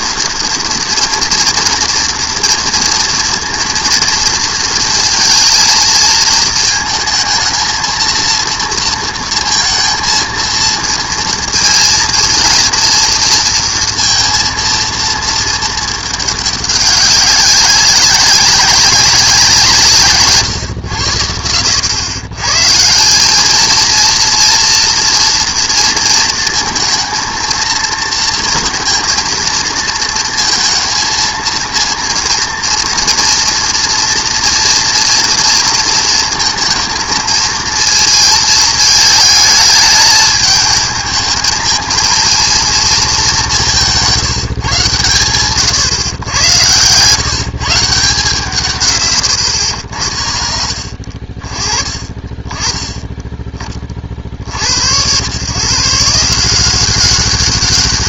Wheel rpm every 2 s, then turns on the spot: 230, 230, 230, 230, 230, 230, 240, 230, 200, 190, 120, 150, 230, 230, 230, 230, 230, 230, 230, 220, 220, 230, 140, 120, 150, 60, 20, 70, 180.
none